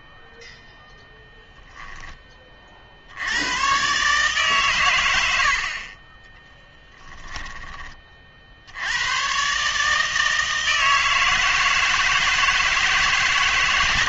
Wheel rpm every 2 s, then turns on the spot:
0, 40, 120, 10, 70, 160, 160.
6-8